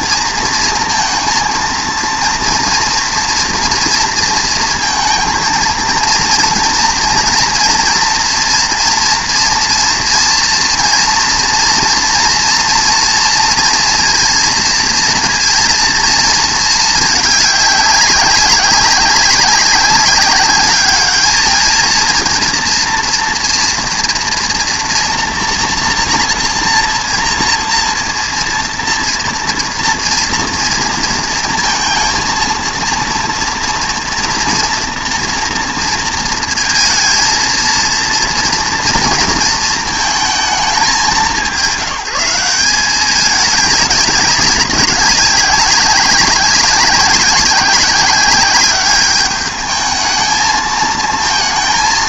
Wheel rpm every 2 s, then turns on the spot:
230, 240, 230, 230, 230, 230, 230, 230, 220, 200, 210, 230, 240, 230, 230, 230, 230, 240, 230, 240, 200, 190, 200, 190, 200, 220.
none